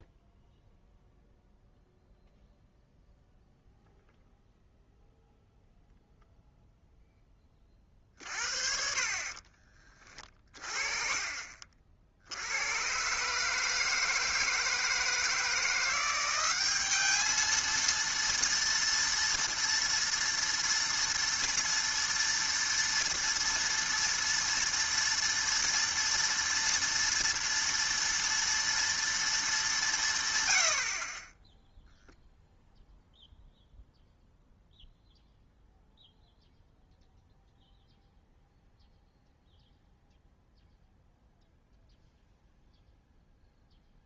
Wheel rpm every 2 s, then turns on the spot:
0, 0, 0, 0, 40, 30, 110, 160, 200, 230, 230, 230, 230, 230, 230, 80, 0, 0, 0, 0, 0, 0.
none